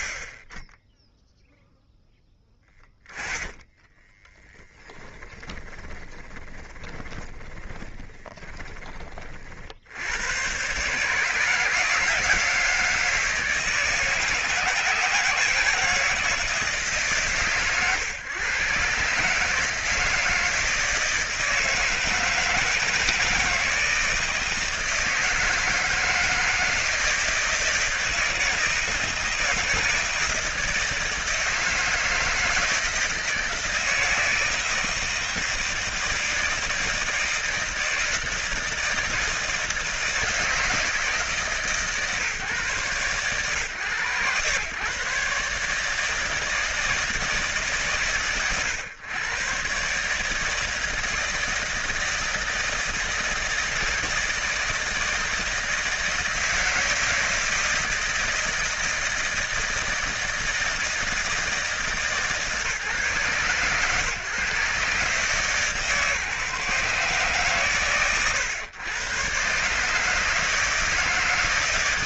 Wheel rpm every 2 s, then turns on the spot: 50, 30, 20, 20, 20, 130, 160, 160, 150, 120, 160, 160, 160, 160, 170, 160, 160, 160, 160, 160, 160, 130, 110, 160, 100, 160, 160, 160, 160, 160, 160, 140, 130, 130, 110, 150.
2-8